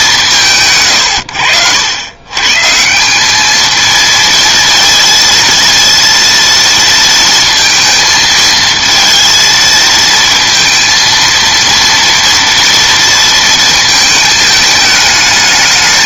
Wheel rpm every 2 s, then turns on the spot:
150, 140, 230, 230, 230, 230, 230, 220.
none